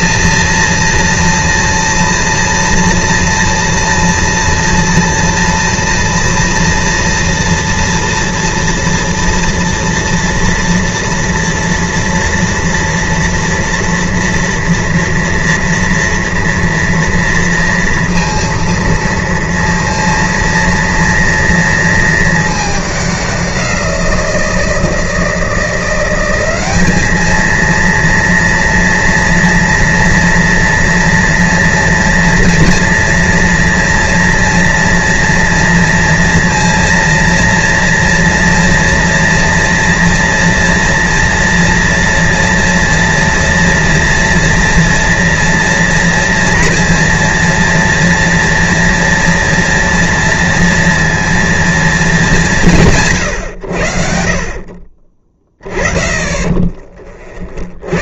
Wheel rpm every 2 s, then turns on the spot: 240, 230, 230, 230, 230, 230, 230, 230, 230, 230, 230, 220, 170, 190, 230, 230, 230, 230, 230, 230, 230, 240, 230, 230, 230, 230, 200, 60, 30.
56-58